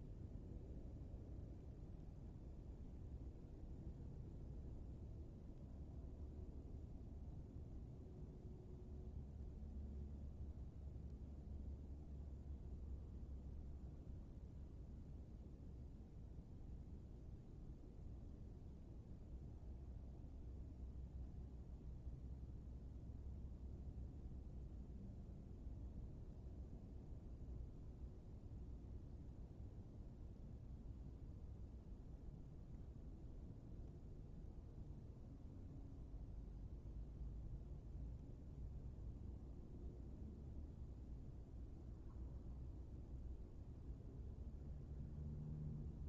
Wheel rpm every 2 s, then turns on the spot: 0, 0, 0, 0, 0, 0, 0, 0, 0, 0, 0, 0, 0, 0, 0, 0, 0, 0, 0, 0, 0, 0, 0.
none